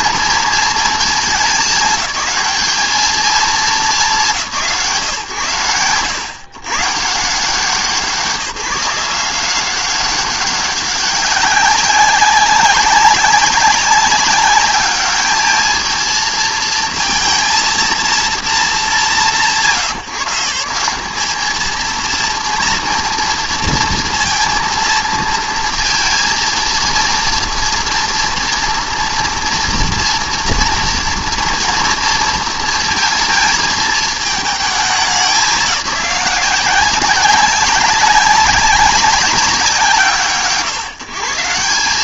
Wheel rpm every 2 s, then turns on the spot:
220, 210, 130, 110, 170, 200, 200, 210, 230, 180, 180, 230, 230, 230, 230, 230, 230, 210, 180, 200, 130.
none